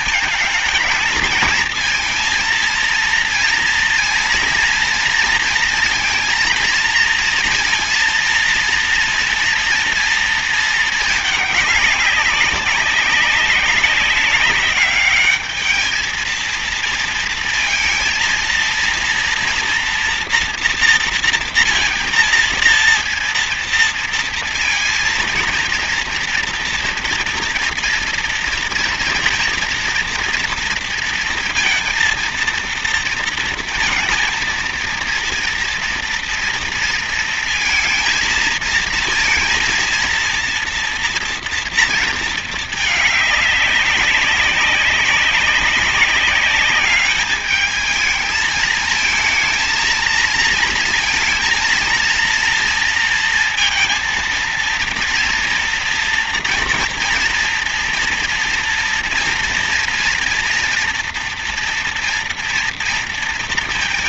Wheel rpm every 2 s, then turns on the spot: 220, 230, 230, 230, 230, 220, 200, 200, 230, 230, 230, 230, 230, 230, 230, 230, 230, 230, 230, 230, 230, 220, 200, 210, 220, 230, 230, 230, 230, 230, 240, 230.
none